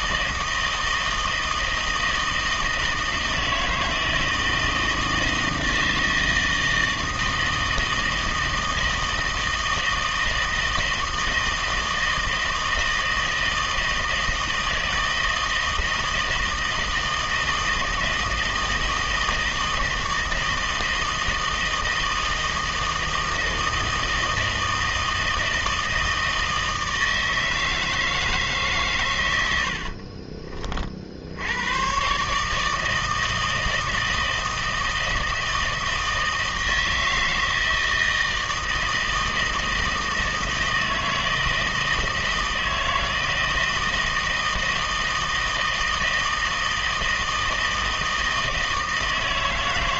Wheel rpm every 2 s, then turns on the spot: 160, 160, 160, 160, 160, 160, 160, 160, 160, 160, 160, 160, 160, 160, 130, 40, 160, 160, 160, 160, 160, 160, 160, 160, 160.
none